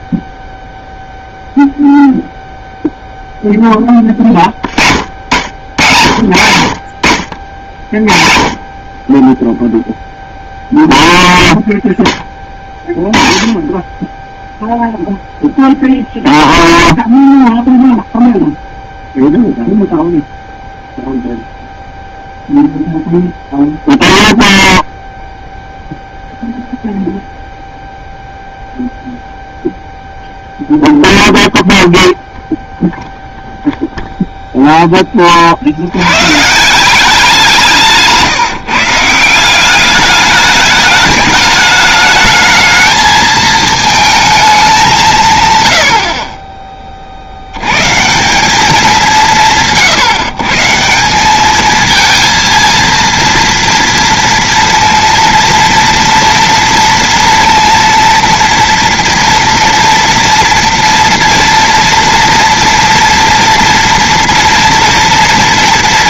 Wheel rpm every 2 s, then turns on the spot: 0, 0, 70, 60, 20, 0, 30, 0, 0, 0, 0, 0, 0, 0, 0, 0, 0, 20, 180, 160, 210, 220, 160, 60, 180, 190, 230, 230, 240, 230, 230, 230, 230.
none